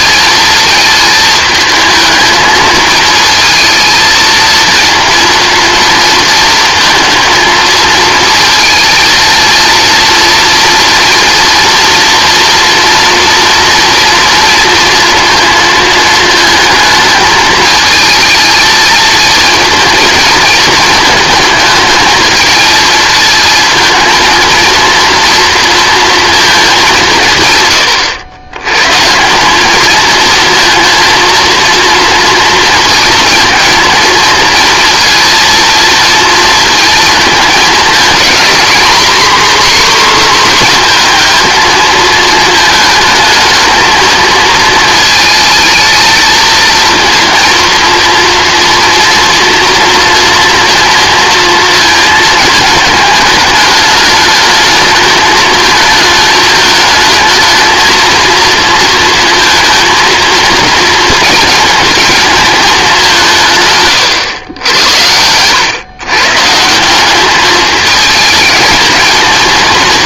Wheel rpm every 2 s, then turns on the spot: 220, 220, 230, 220, 220, 230, 230, 230, 220, 220, 220, 220, 230, 210, 130, 230, 230, 230, 220, 240, 240, 220, 220, 230, 230, 230, 220, 210, 220, 230, 230, 210, 100, 170, 210.
none